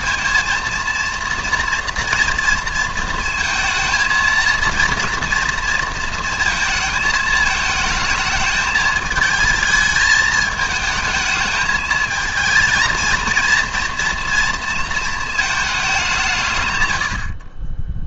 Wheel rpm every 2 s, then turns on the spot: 230, 230, 230, 230, 220, 220, 230, 230, 130.
none